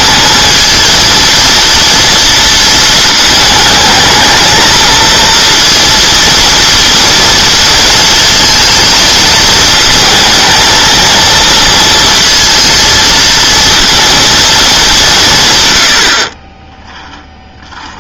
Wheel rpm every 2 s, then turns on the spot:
230, 230, 220, 230, 220, 220, 230, 210, 10.
none